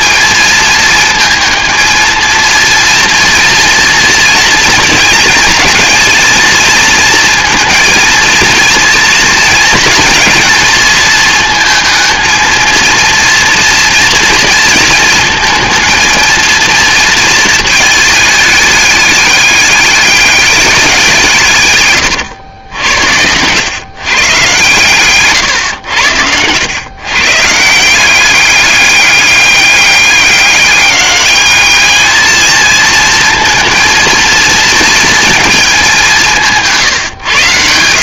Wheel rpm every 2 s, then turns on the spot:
220, 230, 230, 230, 230, 230, 230, 230, 230, 210, 190, 90, 130, 120, 200, 200, 220, 230, 150.
22-24